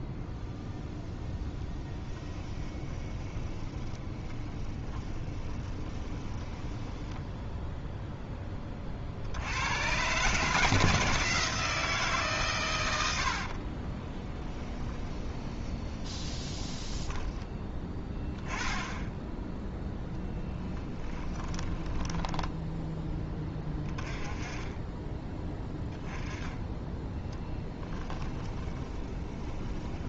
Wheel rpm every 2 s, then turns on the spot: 0, 20, 20, 10, 50, 160, 90, 20, 10, 10, 20, 10, 20, 10, 10.
2-8 14-18 20-22 28-30